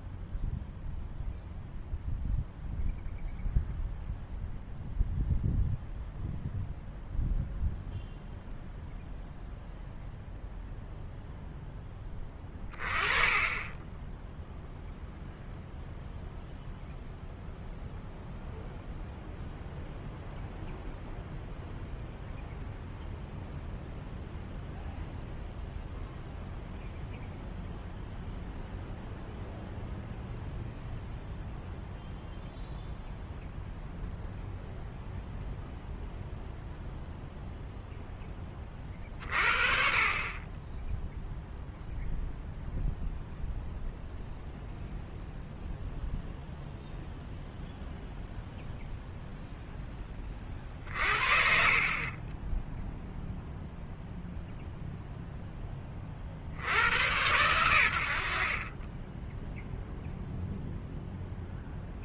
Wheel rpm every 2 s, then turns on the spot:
0, 0, 0, 0, 0, 0, 20, 0, 0, 0, 0, 0, 0, 0, 0, 0, 0, 0, 0, 30, 10, 0, 0, 0, 0, 40, 0, 0, 90, 30, 0.
none